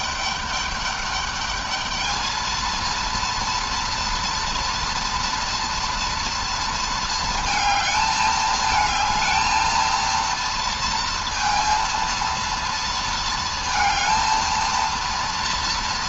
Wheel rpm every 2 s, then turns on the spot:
210, 230, 230, 230, 220, 230, 230, 230.
none